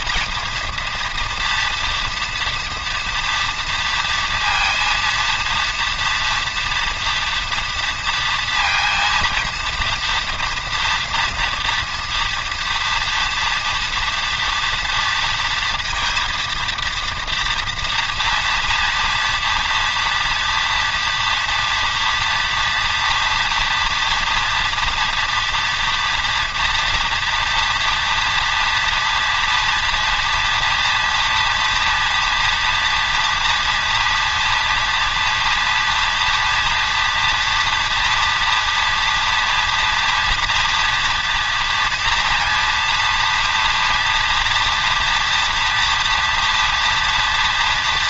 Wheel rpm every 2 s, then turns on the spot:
230, 230, 230, 230, 230, 240, 230, 230, 230, 230, 230, 230, 230, 230, 230, 240, 240, 240, 230, 240, 230, 230, 230, 230.
none